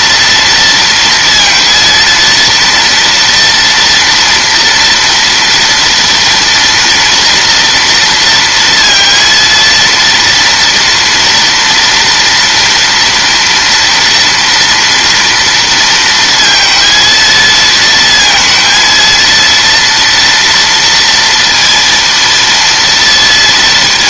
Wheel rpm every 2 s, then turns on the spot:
230, 230, 230, 230, 230, 230, 230, 230, 220, 230, 230, 230.
none